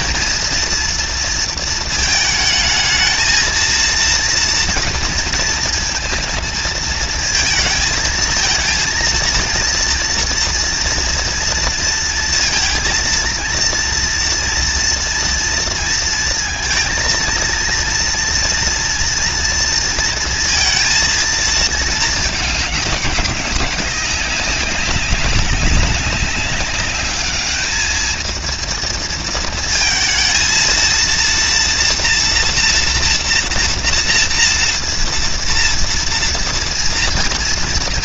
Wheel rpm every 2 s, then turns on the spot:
230, 230, 230, 230, 220, 230, 230, 230, 230, 230, 230, 230, 190, 200, 210, 230, 230, 230, 230.
none